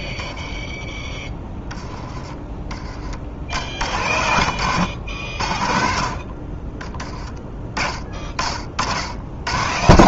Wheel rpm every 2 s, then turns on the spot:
10, 20, 90, 30, 60.
none